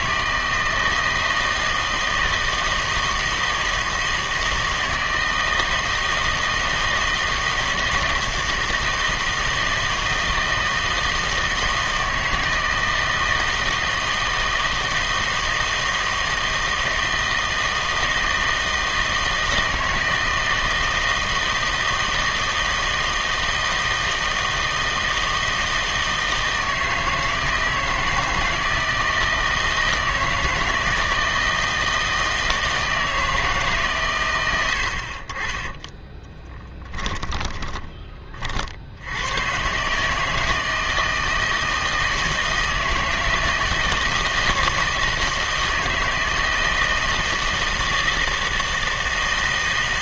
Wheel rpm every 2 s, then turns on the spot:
160, 160, 160, 160, 160, 160, 160, 160, 160, 160, 160, 160, 160, 160, 160, 160, 160, 90, 10, 50, 160, 160, 160, 160, 160.
36-38